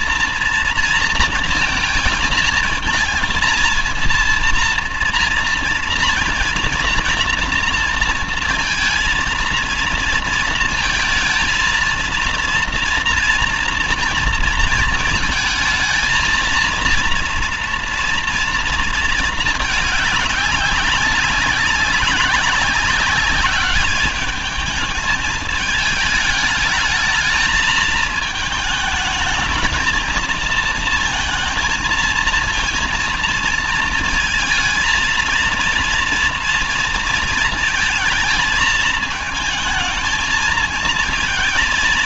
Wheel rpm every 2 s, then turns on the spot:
230, 220, 230, 230, 220, 230, 230, 230, 230, 230, 200, 190, 210, 210, 220, 230, 230, 230, 230, 220, 220.
none